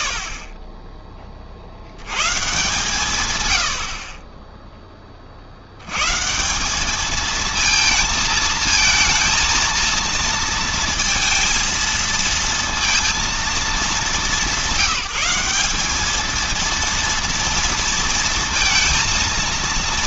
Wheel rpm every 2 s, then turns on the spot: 80, 10, 130, 220, 230, 230, 200, 220, 230, 230.
none